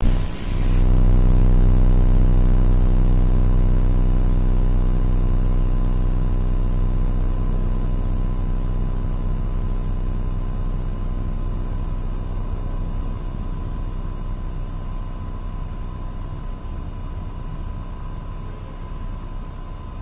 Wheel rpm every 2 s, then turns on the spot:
0, 0, 0, 0, 0, 0, 0, 0, 0, 0.
none